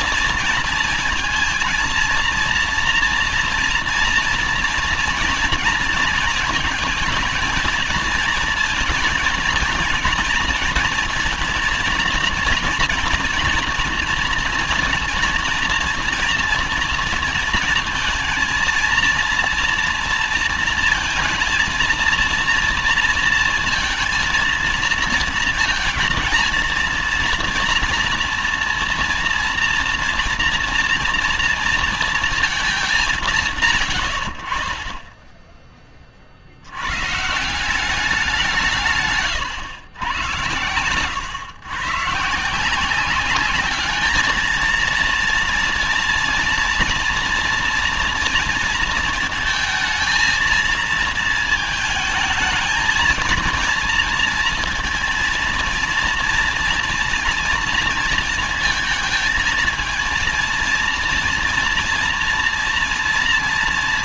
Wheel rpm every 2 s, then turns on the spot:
230, 230, 230, 220, 230, 230, 230, 240, 230, 230, 230, 230, 230, 230, 230, 240, 220, 70, 60, 170, 110, 160, 220, 230, 230, 220, 220, 230, 230, 230, 230, 230.
none